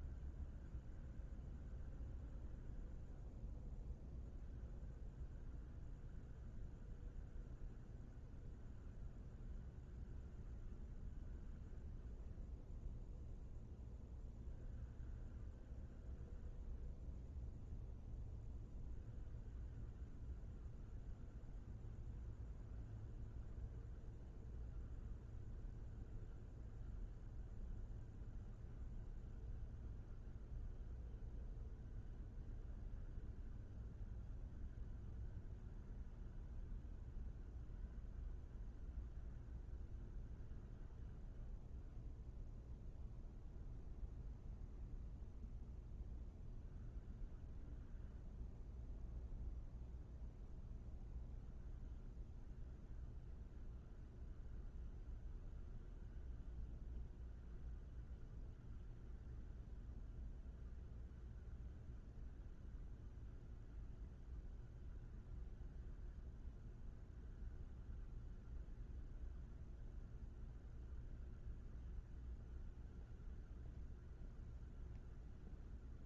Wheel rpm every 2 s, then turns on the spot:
0, 0, 0, 0, 0, 0, 0, 0, 0, 0, 0, 0, 0, 0, 0, 0, 0, 0, 0, 0, 0, 0, 0, 0, 0, 0, 0, 0, 0, 0, 0, 0, 0, 0, 0, 0, 0, 0.
none